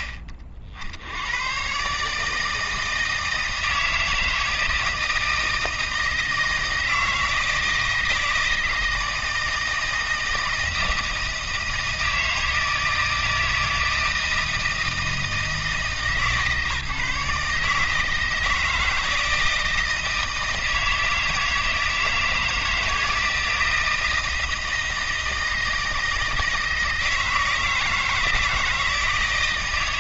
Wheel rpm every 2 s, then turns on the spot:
40, 160, 160, 160, 160, 160, 160, 160, 140, 160, 160, 160, 160, 160, 160.
none